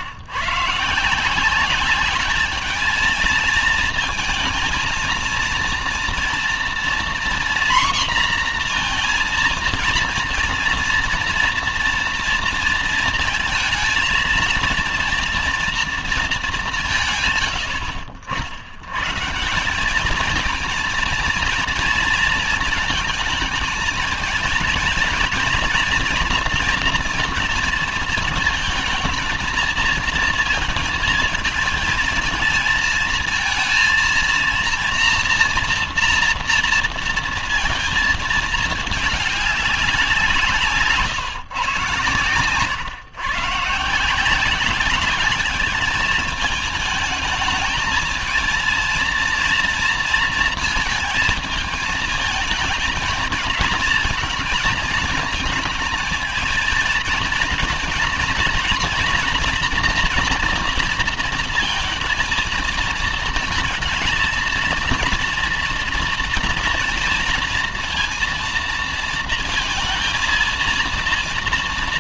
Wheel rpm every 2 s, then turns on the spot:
130, 220, 230, 240, 240, 240, 230, 230, 200, 80, 230, 230, 230, 230, 230, 230, 220, 230, 230, 220, 170, 130, 180, 210, 230, 230, 220, 230, 220, 230, 230, 230, 230, 230, 230, 230.
none